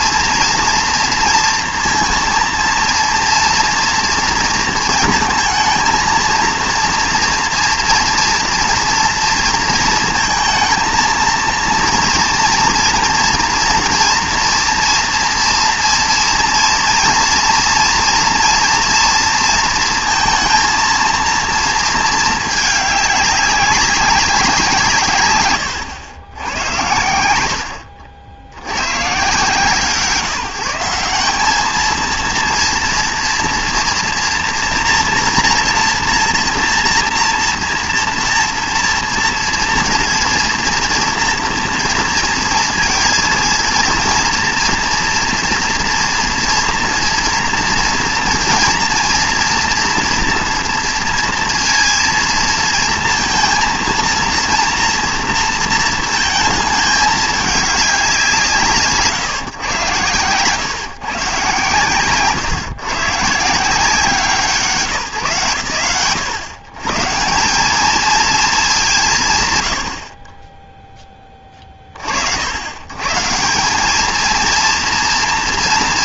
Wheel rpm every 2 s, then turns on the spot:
230, 230, 230, 230, 230, 220, 230, 240, 230, 230, 230, 210, 180, 90, 70, 170, 230, 240, 240, 230, 230, 230, 230, 230, 240, 230, 230, 230, 220, 130, 130, 140, 170, 110, 230, 20, 80, 230.
62-64